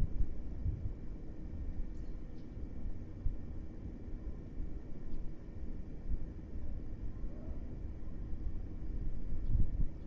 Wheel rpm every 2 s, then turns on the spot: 0, 0, 0, 0, 0.
none